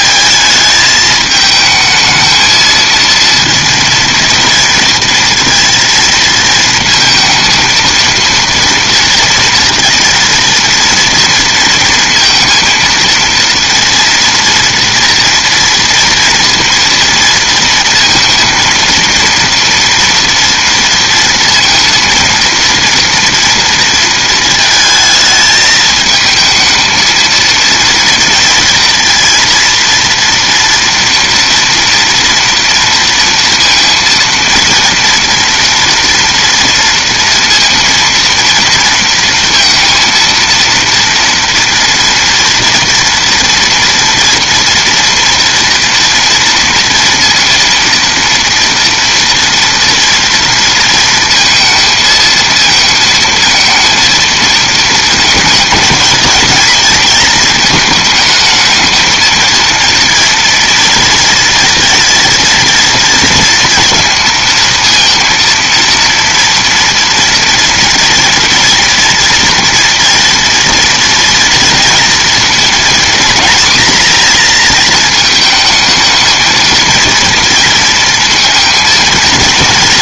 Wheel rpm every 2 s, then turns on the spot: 220, 230, 230, 230, 230, 230, 230, 230, 230, 230, 230, 230, 220, 220, 230, 230, 230, 230, 230, 230, 230, 230, 230, 230, 230, 230, 220, 220, 230, 220, 230, 230, 230, 240, 240, 230, 230, 230, 230, 230.
none